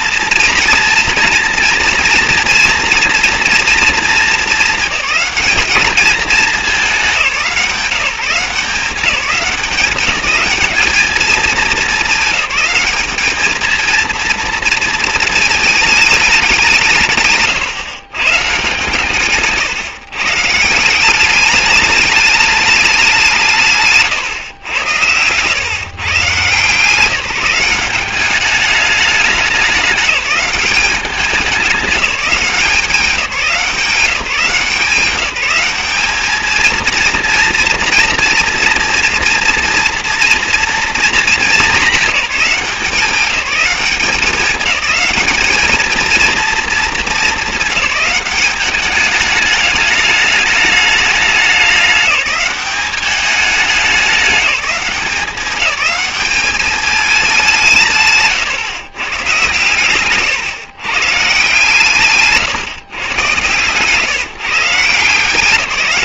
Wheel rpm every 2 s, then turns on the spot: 230, 230, 220, 200, 180, 200, 200, 230, 190, 160, 170, 210, 110, 160, 200, 200, 180, 180, 220, 240, 230, 180, 200, 230, 200, 210, 190, 190, 210, 140, 130, 150, 160.
none